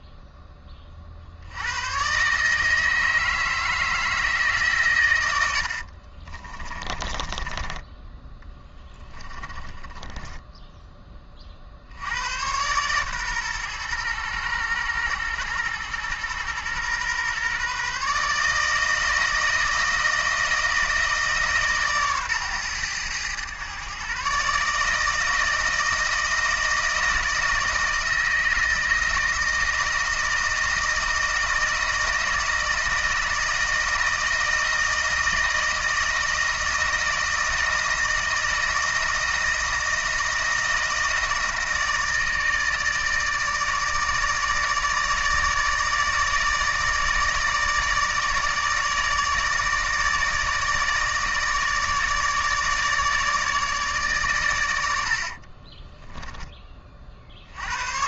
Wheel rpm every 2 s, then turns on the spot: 30, 160, 120, 30, 10, 10, 120, 110, 120, 160, 160, 120, 150, 160, 160, 160, 160, 160, 160, 160, 160, 160, 160, 160, 160, 150, 150, 80, 40.
6-10 54-56